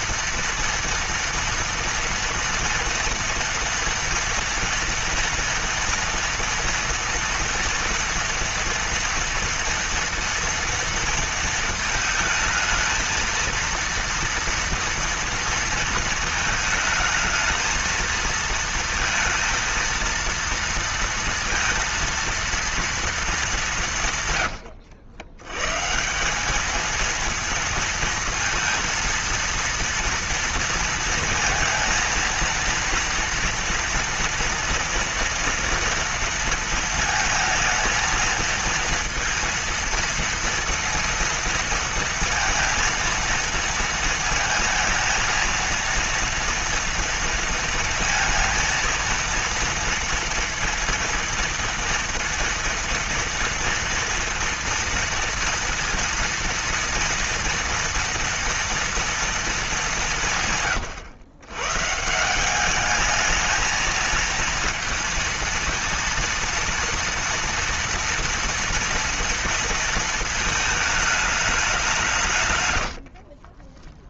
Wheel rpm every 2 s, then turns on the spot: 230, 230, 230, 230, 230, 230, 220, 230, 230, 230, 230, 230, 110, 210, 230, 230, 230, 230, 230, 230, 230, 230, 230, 230, 230, 230, 230, 230, 230, 230, 140, 200, 230, 230, 230, 220, 140.
none